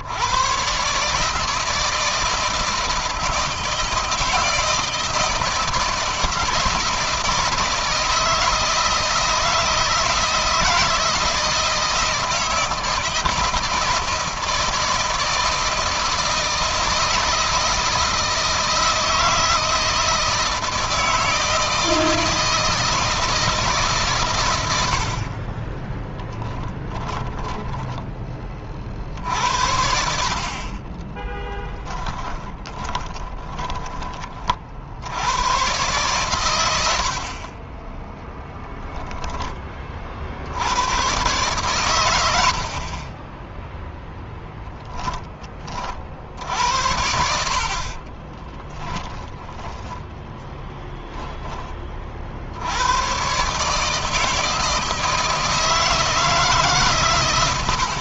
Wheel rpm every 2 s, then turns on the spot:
140, 160, 160, 160, 160, 160, 160, 160, 160, 160, 160, 160, 70, 20, 50, 20, 10, 70, 80, 10, 110, 30, 10, 70, 10, 10, 100, 160, 140.
26-28 30-34 48-50